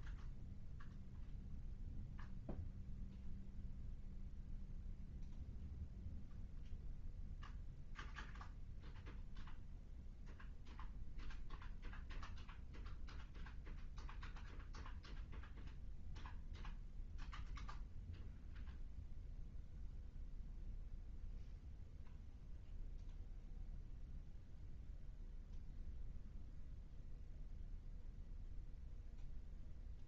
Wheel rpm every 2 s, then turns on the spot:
0, 0, 0, 0, 0, 0, 0, 0, 0, 0, 0, 0, 0, 0, 0.
none